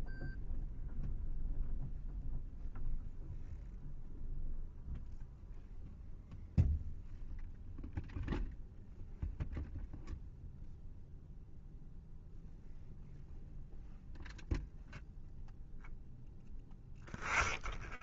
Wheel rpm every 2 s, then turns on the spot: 0, 0, 0, 0, 0, 0, 0, 0, 0.
none